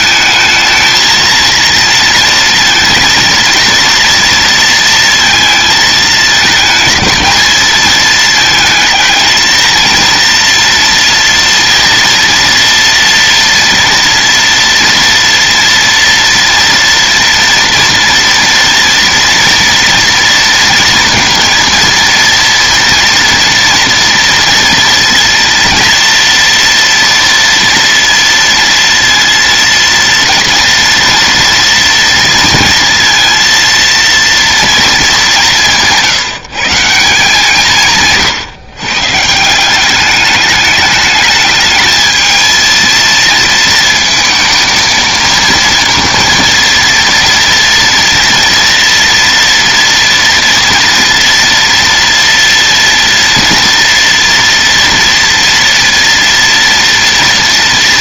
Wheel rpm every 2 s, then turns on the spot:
220, 230, 230, 220, 220, 230, 230, 230, 230, 230, 230, 240, 230, 230, 230, 230, 230, 230, 170, 130, 210, 230, 230, 230, 230, 230, 230, 230, 230.
none